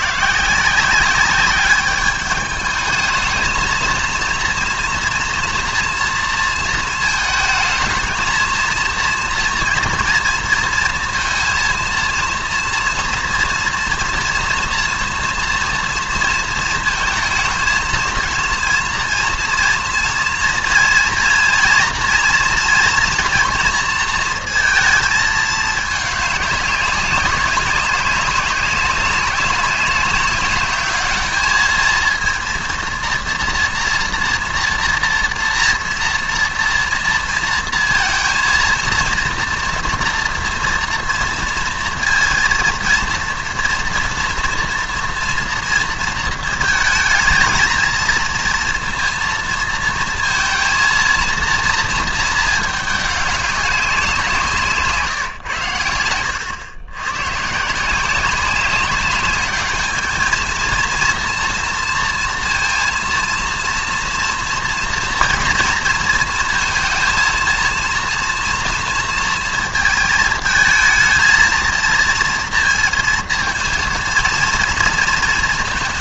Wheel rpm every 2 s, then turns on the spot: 170, 210, 230, 230, 220, 230, 230, 230, 230, 230, 230, 230, 230, 200, 200, 200, 230, 240, 230, 230, 230, 230, 230, 230, 230, 220, 220, 170, 100, 190, 220, 230, 230, 230, 230, 220, 230, 230.
none